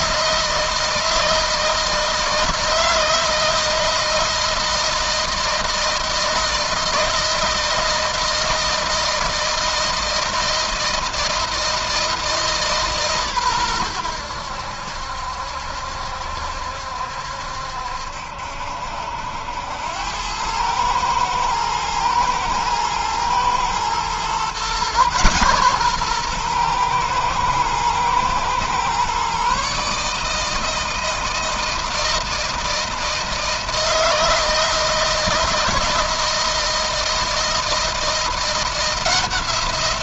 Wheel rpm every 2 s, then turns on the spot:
160, 160, 160, 160, 160, 160, 150, 80, 70, 70, 110, 120, 130, 110, 130, 160, 160, 160, 160, 170.
none